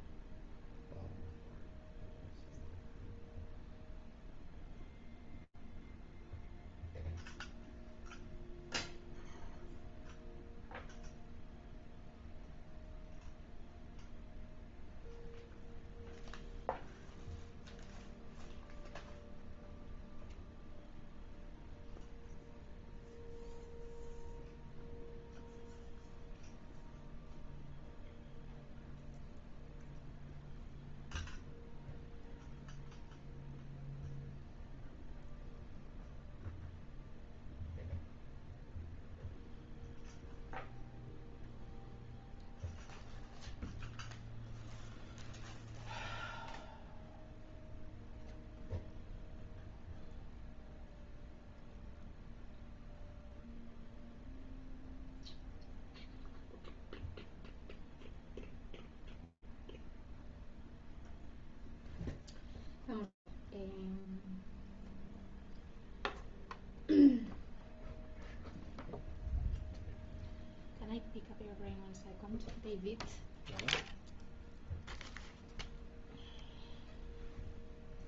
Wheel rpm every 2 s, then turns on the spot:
0, 0, 0, 0, 0, 0, 0, 0, 0, 0, 0, 0, 0, 0, 0, 0, 0, 0, 0, 0, 0, 0, 0, 0, 0, 0, 0, 0, 0, 0, 0, 0, 0, 0, 0, 0, 0, 0, 0.
none